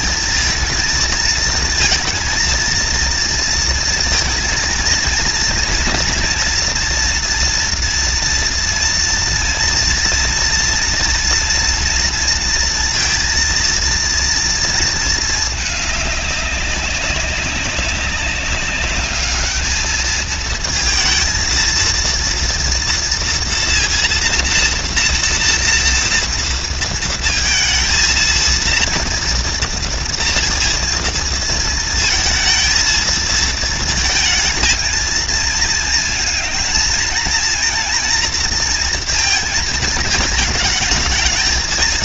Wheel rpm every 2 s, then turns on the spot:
230, 230, 230, 230, 230, 230, 230, 230, 200, 200, 230, 230, 230, 230, 230, 230, 230, 220, 230, 230, 220.
none